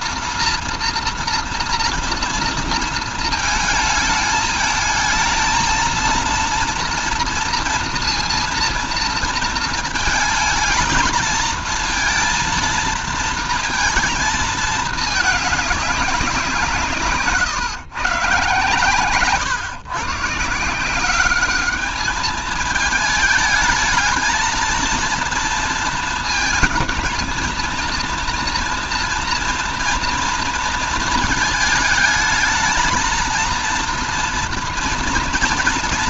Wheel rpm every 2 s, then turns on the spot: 230, 230, 220, 230, 230, 220, 230, 220, 170, 140, 150, 220, 230, 230, 230, 230, 220, 230.
none